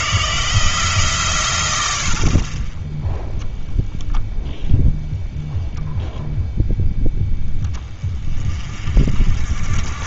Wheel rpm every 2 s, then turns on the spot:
150, 10, 0, 20, 50.
2-4